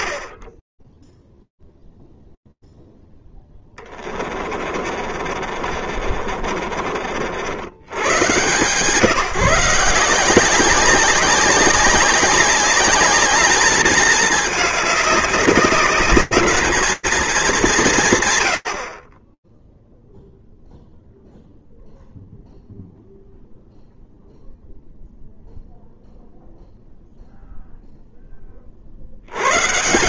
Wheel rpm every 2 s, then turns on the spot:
100, 0, 30, 40, 120, 190, 200, 210, 210, 110, 0, 0, 0, 0, 110.
4-8